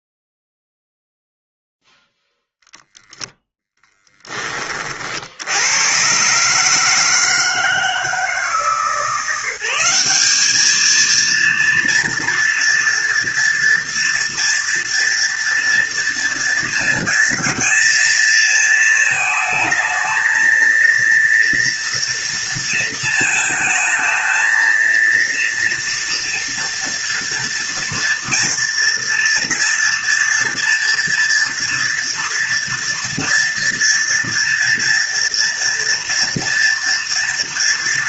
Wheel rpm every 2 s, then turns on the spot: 0, 0, 50, 160, 170, 230, 230, 240, 230, 220, 230, 220, 230, 230, 230, 230, 240, 230, 230.
none